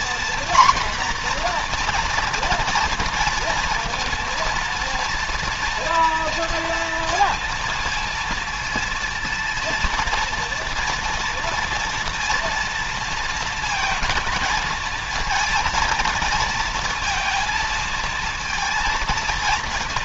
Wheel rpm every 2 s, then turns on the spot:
240, 240, 230, 230, 230, 240, 230, 220, 230, 230.
none